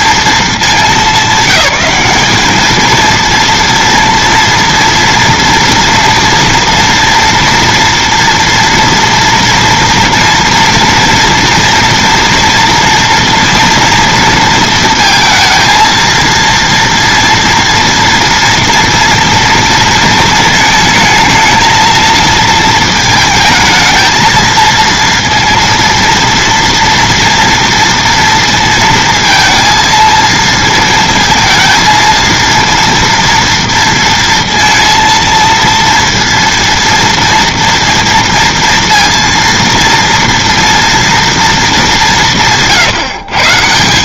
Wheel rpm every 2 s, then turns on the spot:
220, 220, 230, 230, 230, 230, 230, 230, 230, 230, 220, 220, 230, 230, 230, 230, 230, 230, 230, 230, 240, 160.
42-44